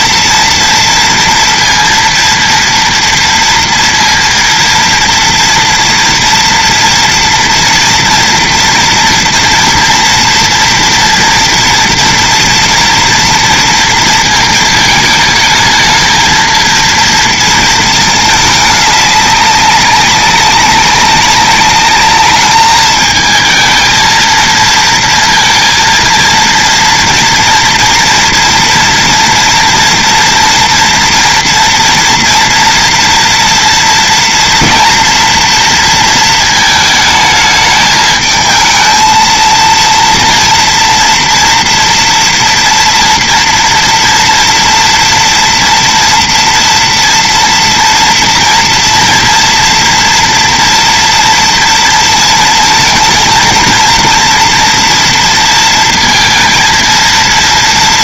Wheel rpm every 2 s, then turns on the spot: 230, 230, 230, 230, 230, 230, 230, 230, 220, 220, 200, 210, 220, 230, 240, 240, 230, 230, 230, 210, 230, 240, 240, 230, 230, 230, 230, 230, 230.
none